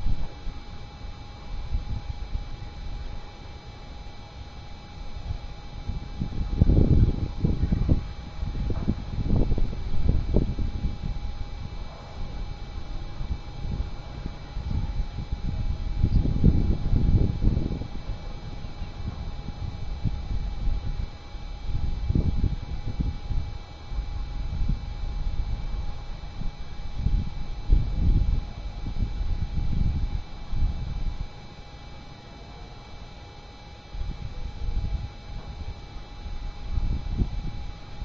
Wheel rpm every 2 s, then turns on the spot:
0, 0, 0, 0, 0, 0, 0, 0, 0, 0, 0, 0, 0, 0, 0, 0, 0, 0, 0.
none